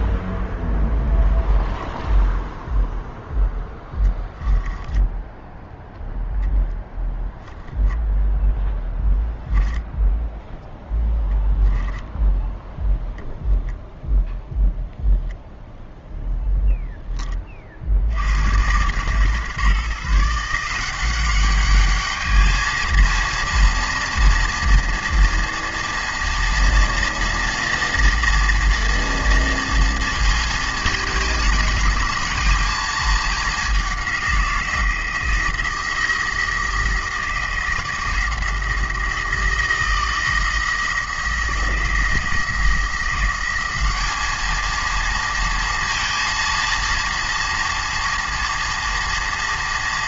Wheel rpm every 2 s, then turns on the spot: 0, 0, 10, 10, 10, 0, 10, 10, 0, 110, 180, 220, 240, 240, 230, 230, 220, 170, 170, 170, 170, 170, 220, 230, 230.
4-6 8-10